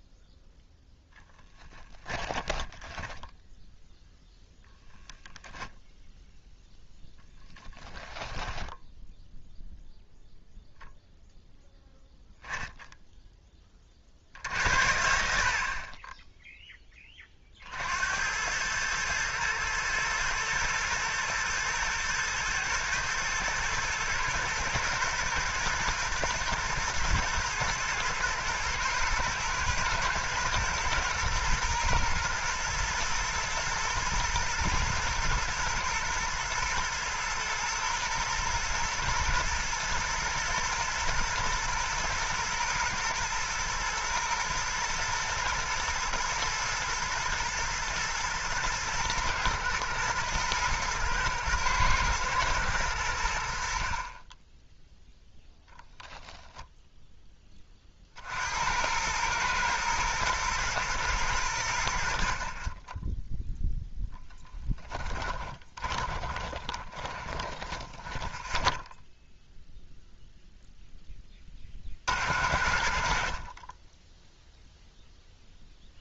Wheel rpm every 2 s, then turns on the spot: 10, 10, 0, 0, 10, 0, 0, 70, 10, 110, 110, 120, 110, 120, 110, 120, 120, 110, 110, 120, 110, 110, 110, 110, 120, 120, 100, 10, 10, 80, 110, 20, 20, 20, 0, 0, 40, 0.
2-4 8-10 56-58 64-68